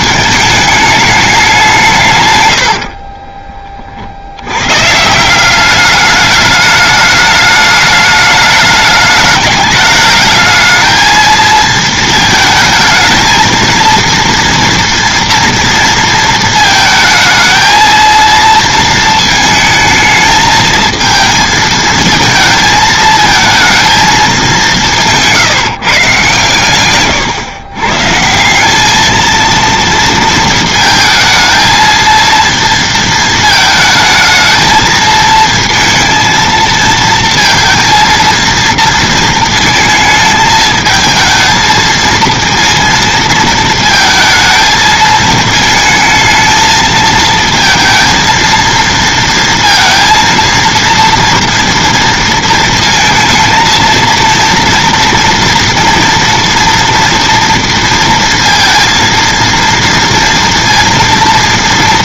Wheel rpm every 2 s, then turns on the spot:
210, 90, 110, 210, 210, 220, 220, 230, 220, 230, 220, 220, 200, 130, 190, 230, 230, 220, 230, 230, 220, 230, 220, 220, 230, 230, 230, 230, 230, 230, 230.
2-4